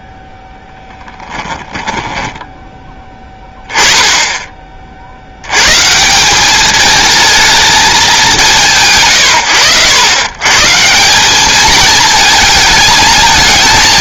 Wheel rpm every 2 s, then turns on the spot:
0, 10, 30, 200, 140, 150, 220.
none